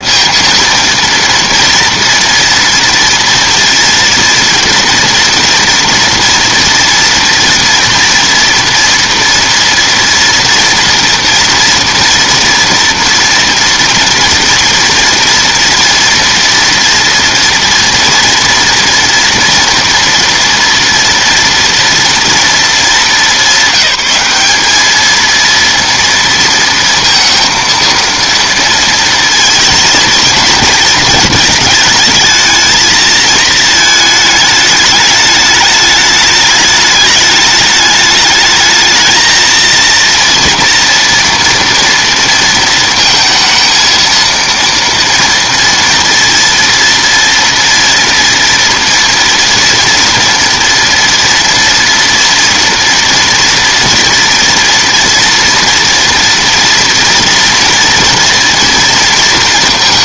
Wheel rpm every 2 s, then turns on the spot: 230, 230, 230, 230, 230, 230, 230, 230, 230, 230, 230, 210, 220, 230, 230, 230, 220, 210, 210, 220, 230, 230, 230, 230, 230, 230, 230, 230, 230, 230.
none